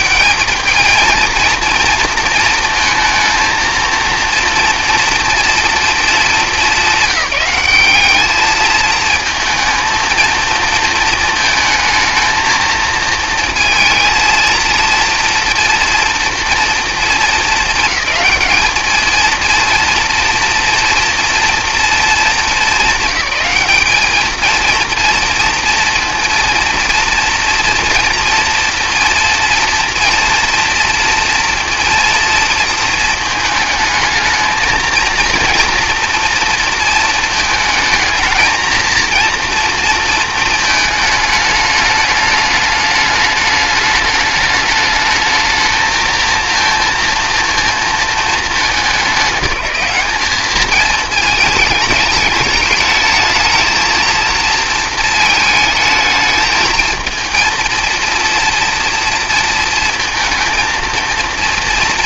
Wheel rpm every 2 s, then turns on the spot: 200, 230, 230, 200, 220, 230, 220, 230, 230, 220, 230, 200, 230, 230, 230, 230, 230, 220, 230, 230, 220, 210, 210, 230, 200, 210, 210, 230, 220, 230, 230.
none